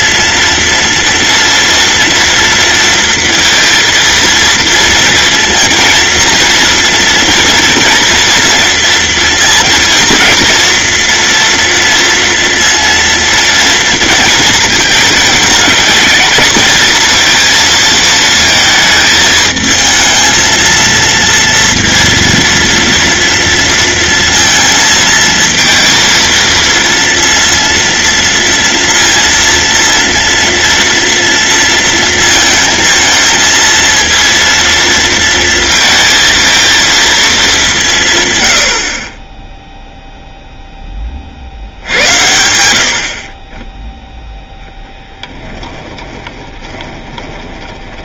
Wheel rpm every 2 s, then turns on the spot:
240, 230, 230, 230, 230, 230, 230, 220, 220, 220, 230, 230, 220, 230, 230, 230, 220, 230, 230, 60, 10, 60, 0, 20.
46-48